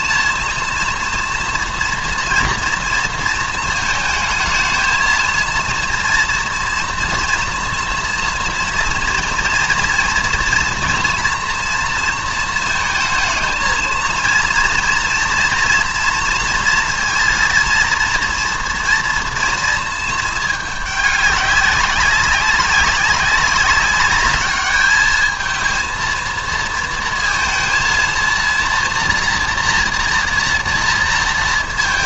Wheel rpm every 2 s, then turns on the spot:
230, 230, 220, 230, 230, 230, 220, 230, 230, 240, 210, 190, 210, 230, 230, 230.
none